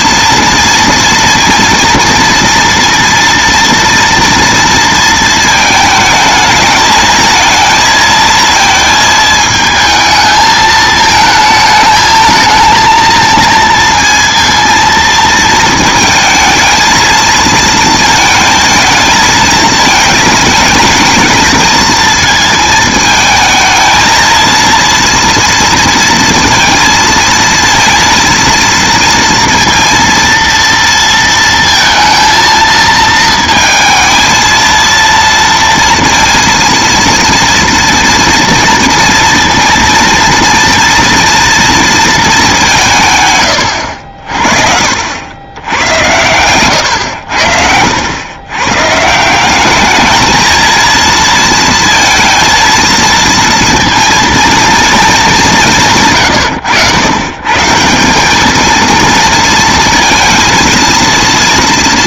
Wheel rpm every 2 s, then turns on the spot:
230, 230, 230, 220, 220, 220, 220, 230, 220, 220, 220, 220, 230, 230, 230, 230, 230, 230, 230, 230, 230, 190, 70, 100, 120, 220, 230, 230, 110, 220, 230.
none